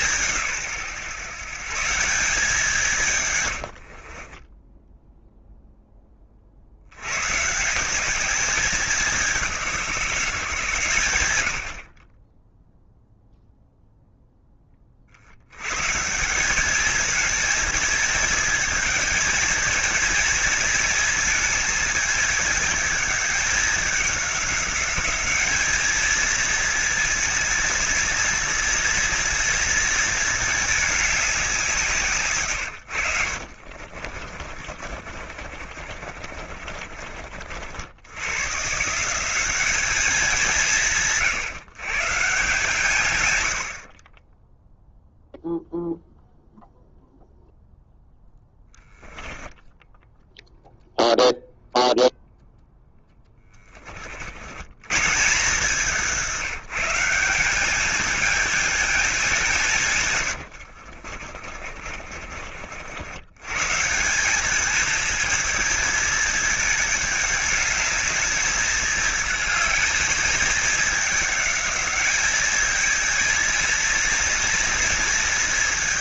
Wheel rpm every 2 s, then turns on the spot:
130, 170, 10, 80, 200, 130, 0, 30, 200, 220, 230, 210, 200, 220, 230, 210, 110, 50, 50, 150, 160, 160, 0, 0, 10, 0, 10, 120, 180, 220, 60, 70, 220, 210, 220, 210, 220, 230.
4-6 34-38 48-50 60-62